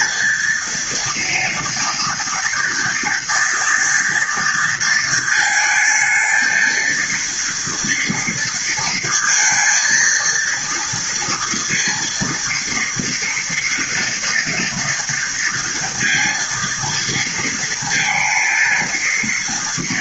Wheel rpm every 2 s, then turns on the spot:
230, 230, 220, 230, 230, 230, 230, 230, 230, 230.
none